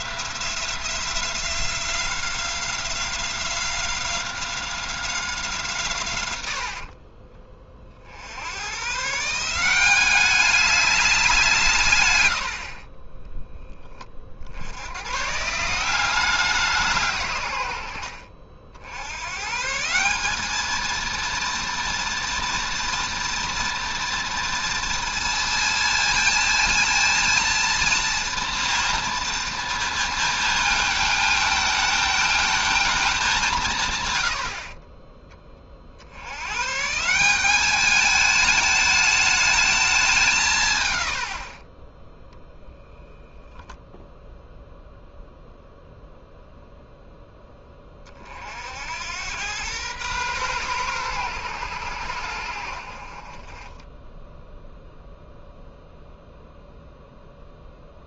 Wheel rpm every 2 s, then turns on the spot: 180, 180, 180, 70, 120, 200, 40, 70, 170, 70, 220, 230, 230, 230, 230, 220, 220, 40, 130, 220, 130, 0, 0, 0, 70, 120, 60, 0, 0.
6-8 34-36